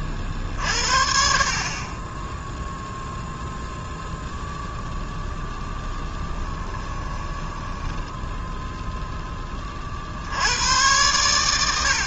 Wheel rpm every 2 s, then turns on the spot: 50, 10, 0, 10, 0, 90.
6-8